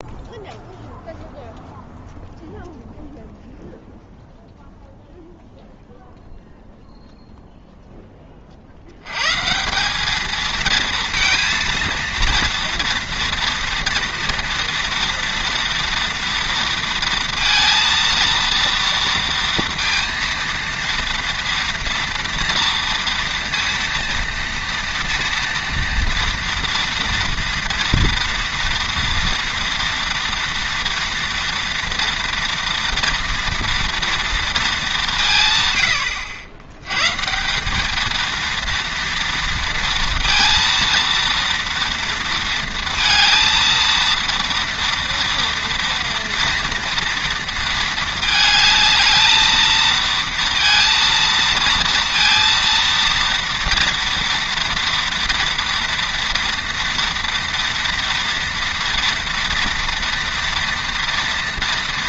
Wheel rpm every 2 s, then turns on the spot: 0, 0, 0, 0, 30, 220, 230, 230, 230, 230, 230, 230, 230, 230, 230, 230, 230, 230, 90, 230, 230, 230, 230, 230, 220, 230, 230, 230, 230, 230, 230.
none